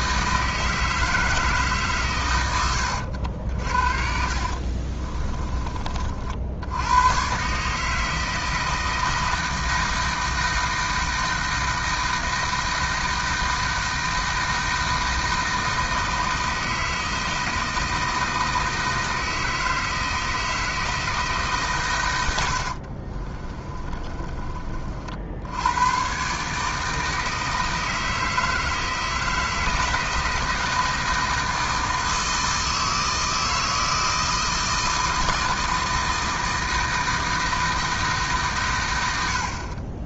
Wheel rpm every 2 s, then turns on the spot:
160, 90, 40, 90, 160, 160, 160, 160, 160, 160, 160, 70, 40, 150, 160, 160, 160, 160, 160, 110.
2-6 22-24